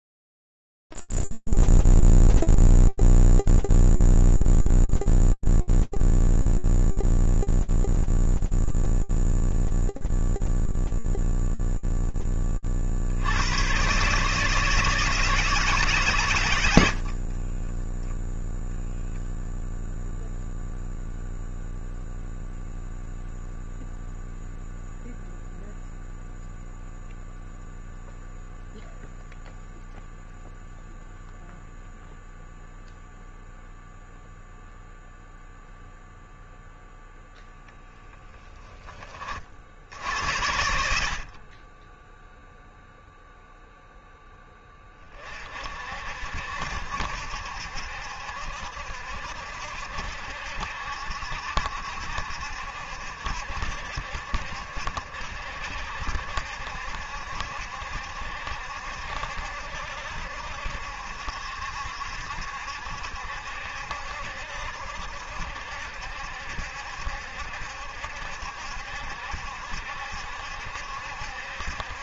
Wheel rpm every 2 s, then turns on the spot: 0, 0, 0, 0, 0, 0, 30, 160, 110, 0, 0, 0, 0, 0, 0, 0, 0, 0, 0, 60, 20, 0, 50, 70, 70, 70, 60, 70, 70, 70, 70, 70, 70, 70, 60, 60.
none